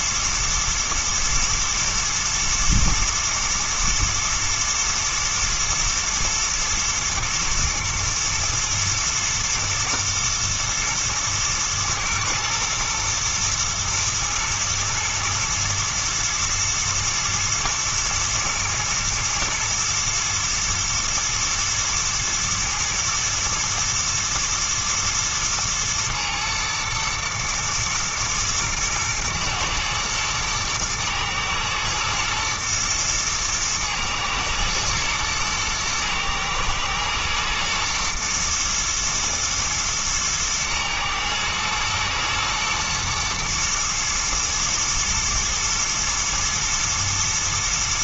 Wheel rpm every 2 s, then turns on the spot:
110, 110, 120, 110, 110, 110, 110, 110, 120, 120, 110, 120, 120, 110, 110, 110, 110, 110, 110, 120, 110, 120, 120, 110.
none